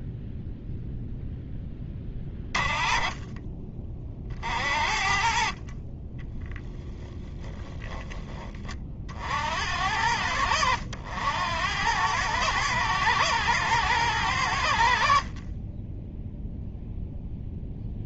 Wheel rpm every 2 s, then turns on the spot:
0, 20, 40, 20, 20, 80, 100, 90, 0.
6-8